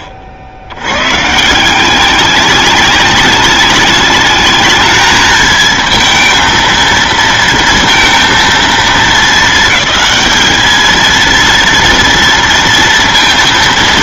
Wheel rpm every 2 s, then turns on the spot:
70, 200, 210, 230, 220, 220, 230.
none